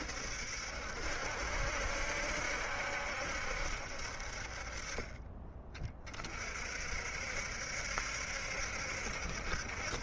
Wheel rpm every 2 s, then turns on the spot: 70, 70, 40, 50, 70.
none